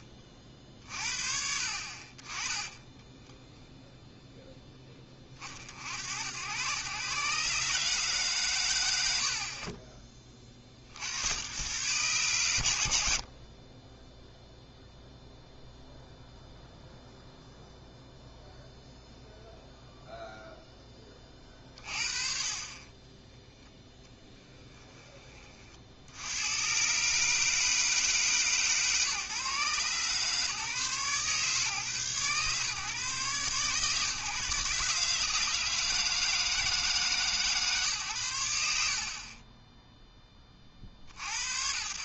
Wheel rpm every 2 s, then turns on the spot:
40, 20, 10, 110, 120, 40, 100, 0, 0, 0, 10, 30, 10, 120, 150, 140, 130, 150, 160, 80, 40.
2-4 24-26